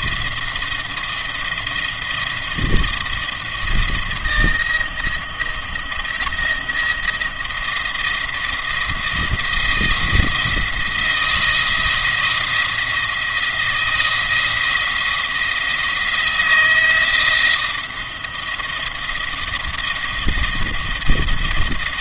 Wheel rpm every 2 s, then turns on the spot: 170, 170, 170, 170, 170, 170, 170, 170, 170, 170, 170.
none